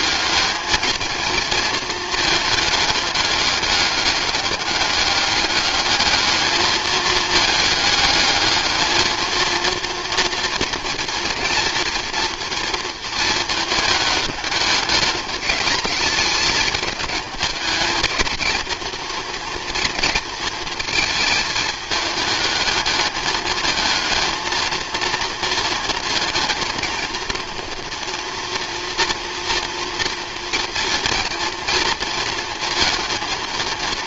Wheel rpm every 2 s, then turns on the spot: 220, 210, 200, 220, 220, 230, 230, 210, 210, 230, 220, 210, 220, 230, 230, 230, 230.
none